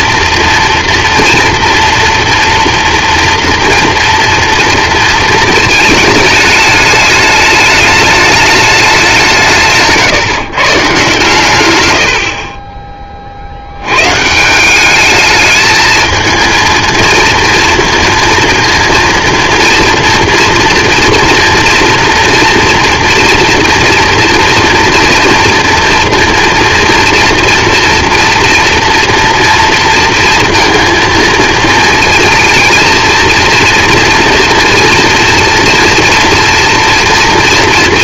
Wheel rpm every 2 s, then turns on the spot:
230, 230, 230, 210, 210, 160, 50, 170, 230, 230, 230, 230, 230, 230, 230, 230, 230, 230, 230.
none